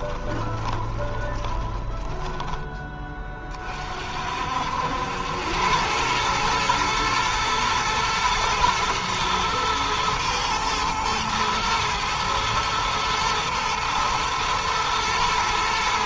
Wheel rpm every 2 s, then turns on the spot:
20, 20, 80, 110, 110, 110, 110, 120.
0-2